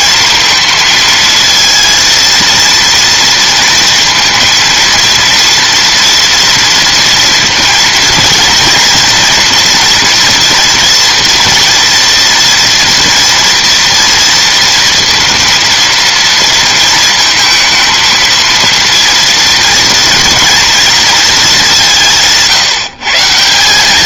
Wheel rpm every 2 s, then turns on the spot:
230, 230, 230, 230, 230, 240, 230, 230, 230, 230, 230, 150.
none